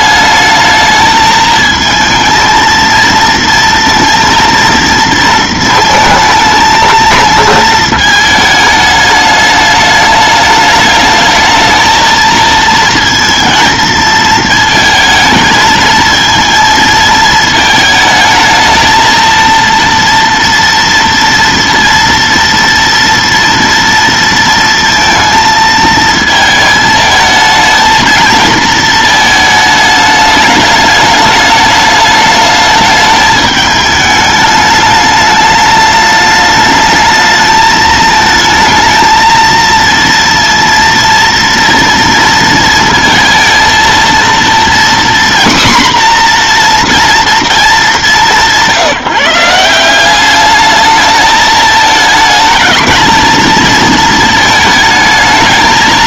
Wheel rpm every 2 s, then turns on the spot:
220, 220, 230, 220, 210, 210, 230, 220, 230, 220, 230, 230, 230, 220, 220, 210, 210, 210, 210, 220, 230, 230, 240, 240, 160, 210, 220, 220.
none